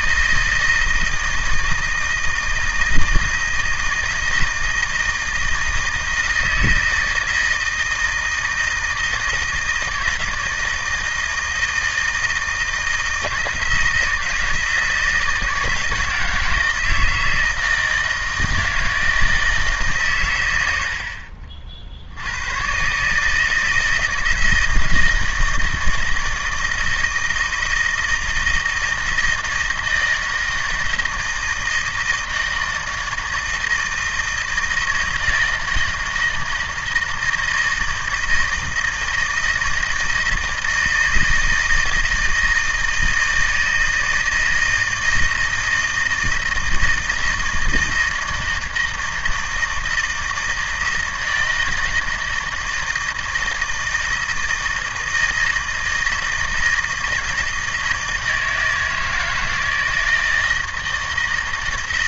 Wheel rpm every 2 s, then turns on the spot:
160, 160, 160, 160, 160, 160, 160, 160, 160, 160, 90, 120, 160, 160, 160, 160, 160, 160, 160, 160, 160, 160, 160, 160, 160, 160, 160, 160, 160, 160, 160.
none